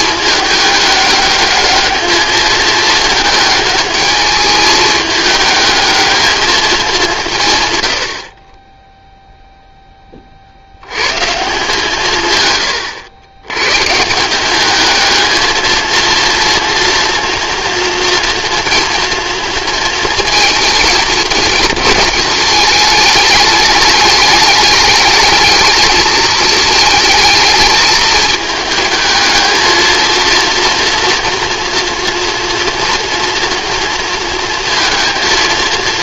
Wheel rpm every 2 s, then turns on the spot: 210, 220, 220, 190, 0, 100, 110, 210, 230, 230, 220, 210, 210, 220, 220, 240, 230, 230.
none